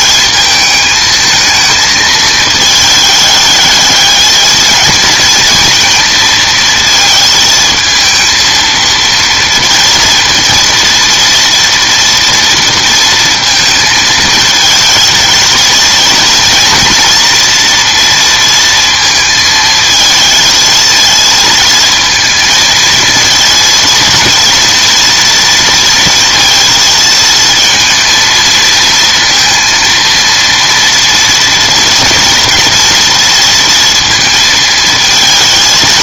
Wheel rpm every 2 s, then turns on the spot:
220, 220, 220, 230, 230, 230, 230, 220, 230, 230, 230, 220, 230, 220, 230, 230, 230, 220.
none